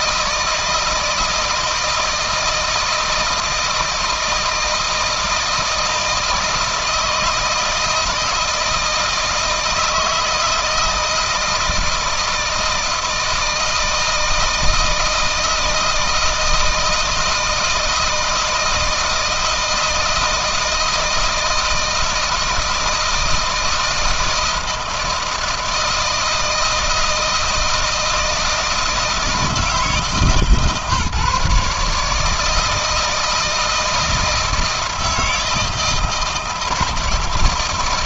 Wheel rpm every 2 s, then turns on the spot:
160, 160, 160, 160, 160, 160, 160, 160, 160, 160, 160, 160, 160, 160, 160, 150, 160, 160, 160.
none